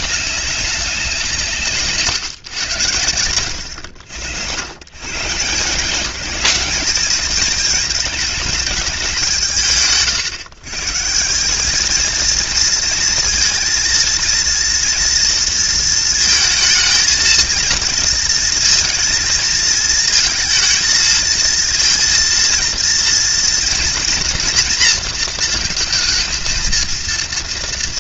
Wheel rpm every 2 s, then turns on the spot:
190, 100, 110, 210, 220, 150, 230, 230, 220, 230, 220, 230, 240, 230.
none